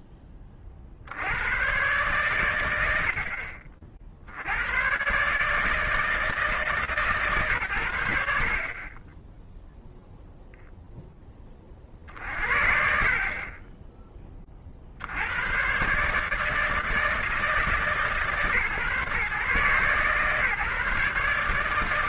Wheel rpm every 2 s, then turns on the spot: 40, 90, 100, 160, 30, 10, 30, 80, 160, 140, 140.
none